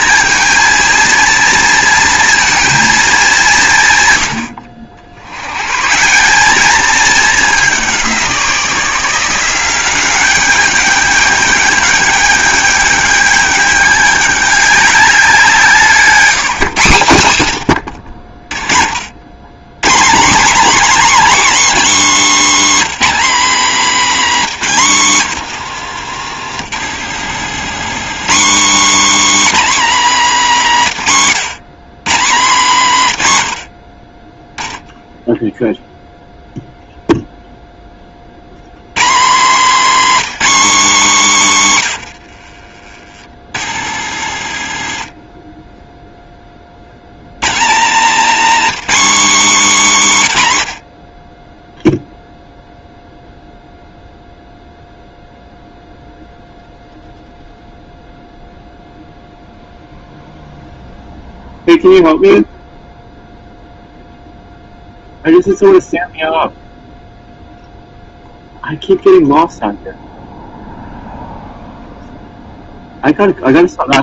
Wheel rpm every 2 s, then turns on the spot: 230, 230, 80, 210, 170, 200, 210, 200, 170, 50, 270, 280, 230, 120, 250, 210, 180, 10, 0, 110, 270, 60, 90, 20, 260, 120, 0, 0, 0, 0, 0, 0, 0, 0, 0, 0, 0.
24-28 44-46